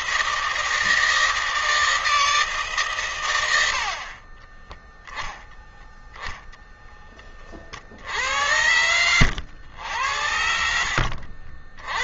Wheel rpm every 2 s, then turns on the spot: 160, 150, 20, 0, 80, 70.
4-6 10-12